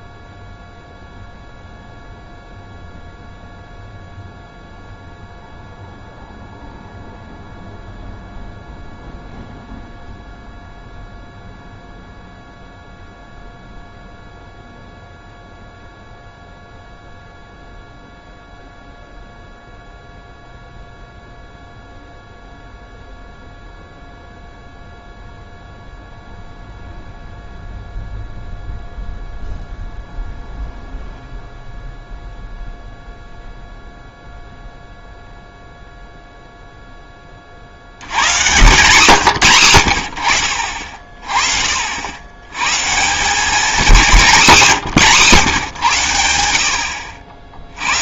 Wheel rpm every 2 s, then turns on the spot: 0, 0, 0, 0, 0, 0, 0, 0, 0, 0, 0, 0, 0, 0, 0, 0, 0, 0, 0, 130, 50, 120, 200, 70.
none